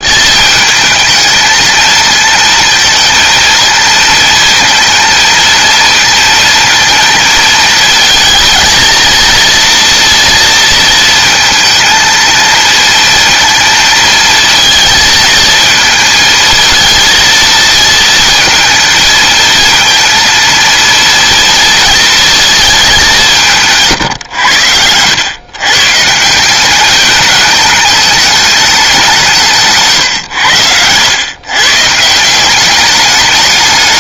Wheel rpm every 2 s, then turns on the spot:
220, 220, 230, 230, 230, 230, 230, 220, 230, 230, 230, 220, 100, 190, 210, 100, 190.
24-26